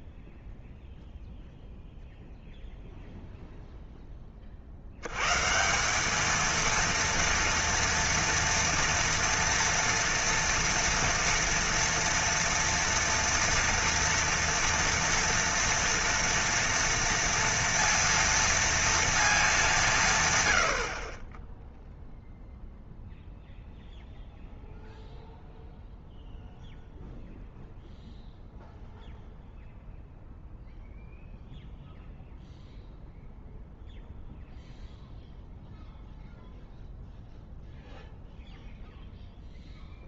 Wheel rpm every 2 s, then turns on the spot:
0, 0, 50, 230, 230, 240, 230, 230, 230, 230, 80, 0, 0, 0, 0, 0, 0, 0, 0, 0.
none